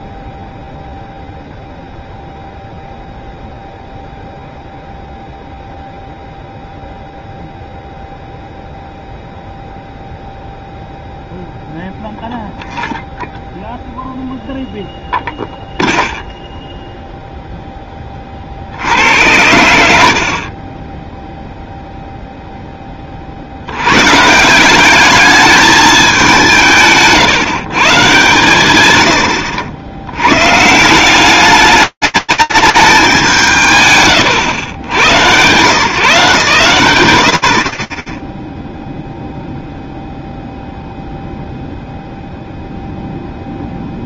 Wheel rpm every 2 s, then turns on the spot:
0, 0, 0, 0, 0, 0, 0, 0, 0, 80, 10, 10, 190, 150, 110, 140, 200, 110, 80, 0, 0, 0.
none